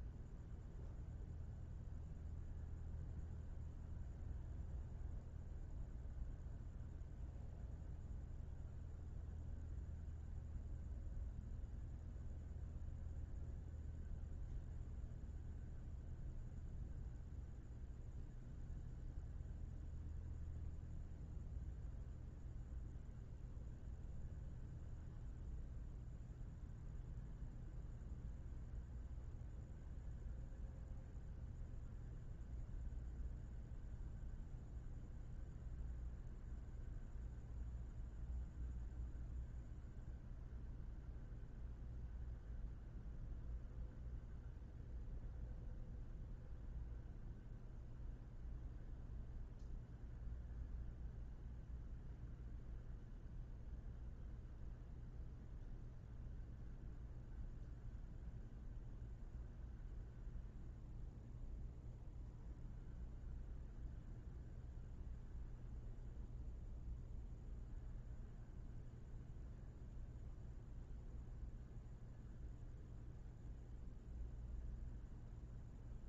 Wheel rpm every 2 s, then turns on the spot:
0, 0, 0, 0, 0, 0, 0, 0, 0, 0, 0, 0, 0, 0, 0, 0, 0, 0, 0, 0, 0, 0, 0, 0, 0, 0, 0, 0, 0, 0, 0, 0, 0, 0, 0, 0, 0, 0.
none